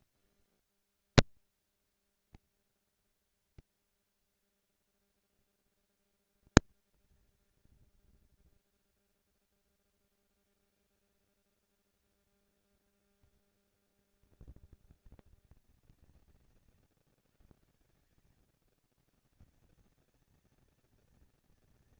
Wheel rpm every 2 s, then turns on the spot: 190, 230, 230, 230, 230, 230, 230, 220, 160, 120, 210.
none